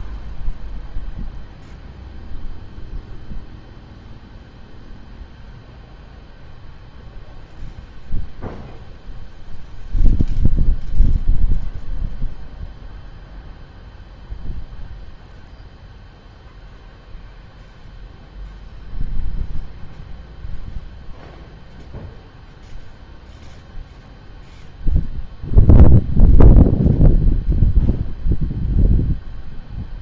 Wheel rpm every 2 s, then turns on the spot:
0, 0, 0, 0, 0, 0, 0, 0, 0, 0, 0, 0, 0, 0, 0.
none